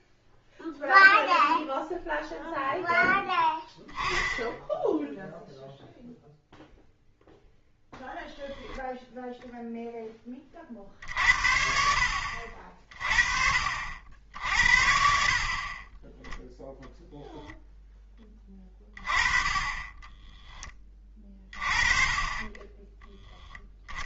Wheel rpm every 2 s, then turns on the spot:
0, 0, 0, 0, 0, 40, 50, 60, 0, 20, 20, 20.
22-24